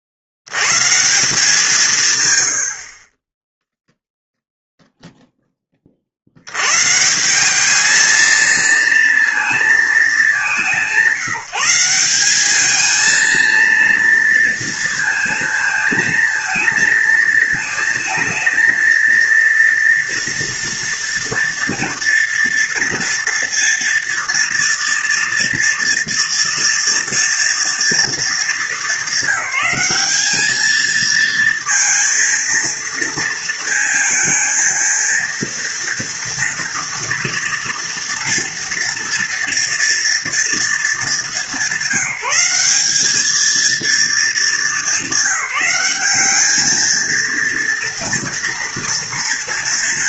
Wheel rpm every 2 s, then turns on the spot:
80, 160, 0, 80, 230, 200, 210, 230, 220, 230, 240, 230, 230, 230, 220, 210, 230, 230, 230, 230, 230, 190, 210, 210, 230.
none